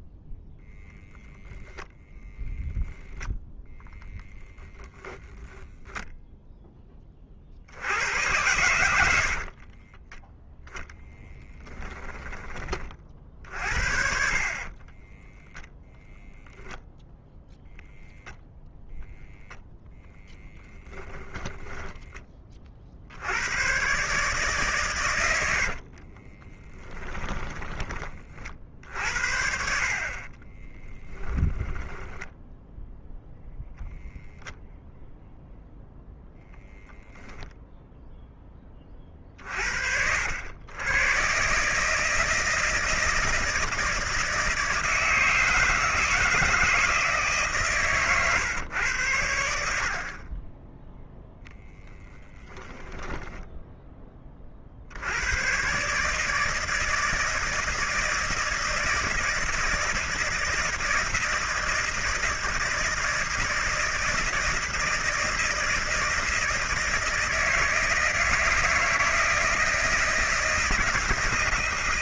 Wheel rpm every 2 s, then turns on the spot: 10, 10, 0, 10, 100, 0, 40, 40, 0, 0, 0, 50, 130, 10, 50, 20, 0, 0, 0, 20, 100, 160, 160, 160, 110, 10, 20, 50, 160, 160, 160, 160, 160, 160, 160, 170.
14-16 26-28 30-32 52-54